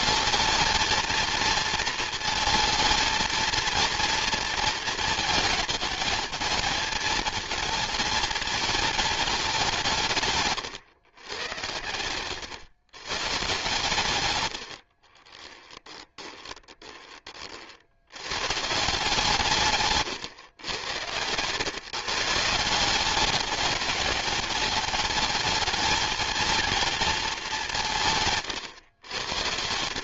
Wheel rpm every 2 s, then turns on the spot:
220, 230, 230, 230, 230, 130, 130, 80, 20, 150, 110, 170, 210, 230, 120.
14-18